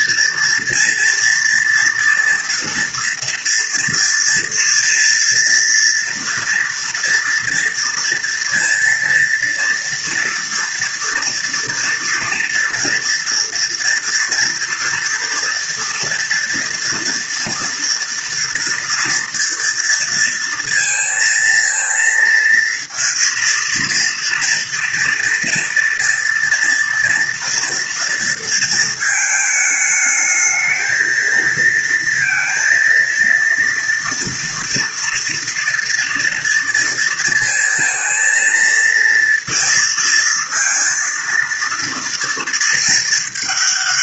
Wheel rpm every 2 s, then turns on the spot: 230, 230, 230, 240, 230, 230, 230, 230, 230, 230, 230, 230, 230, 230, 220, 220, 230, 240, 230, 230, 230, 220.
none